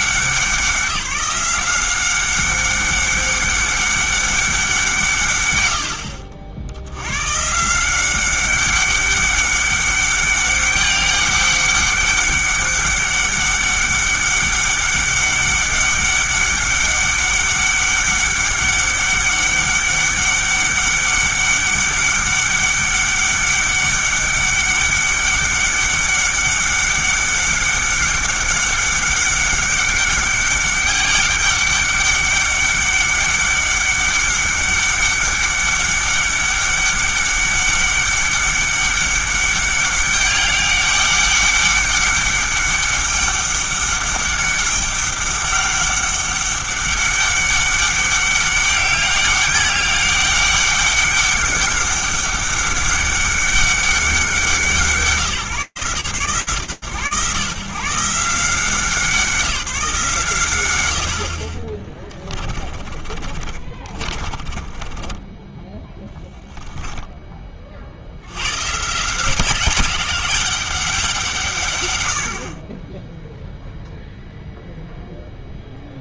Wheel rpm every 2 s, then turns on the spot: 180, 190, 180, 80, 200, 200, 200, 200, 200, 200, 200, 200, 200, 200, 200, 200, 200, 200, 200, 200, 200, 200, 200, 200, 200, 200, 200, 180, 120, 170, 110, 30, 20, 10, 160, 170, 0, 0.
62-66